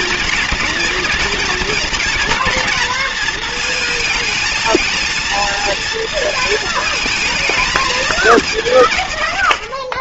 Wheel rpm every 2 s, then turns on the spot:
230, 230, 230, 220, 160.
none